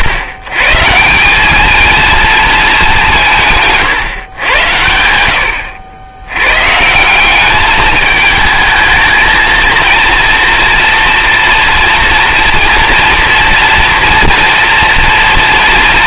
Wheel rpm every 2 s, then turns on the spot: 140, 210, 90, 130, 220, 230, 230, 230.
none